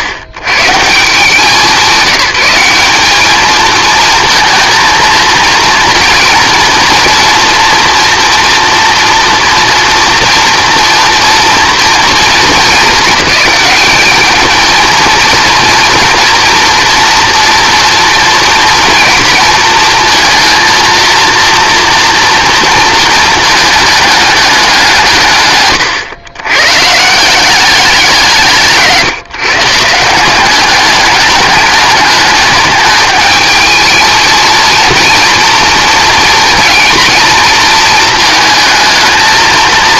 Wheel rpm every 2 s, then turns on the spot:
110, 200, 230, 230, 230, 230, 210, 220, 230, 230, 230, 220, 170, 130, 160, 210, 210, 230, 230, 220.
none